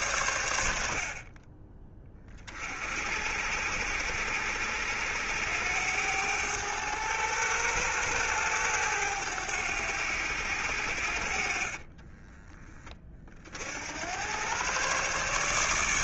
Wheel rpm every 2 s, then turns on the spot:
60, 70, 100, 110, 100, 80, 20, 130.
none